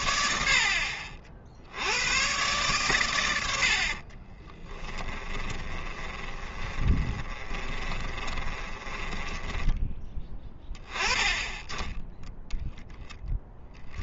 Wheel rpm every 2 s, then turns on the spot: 60, 120, 20, 20, 20, 10, 10.
4-10